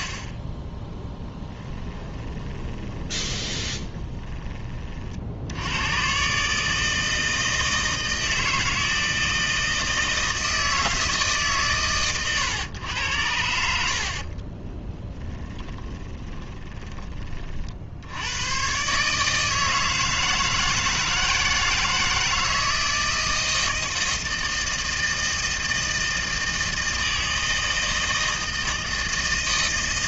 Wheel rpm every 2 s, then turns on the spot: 10, 20, 40, 150, 160, 160, 100, 20, 20, 130, 160, 160, 160, 160, 160.
2-4 14-18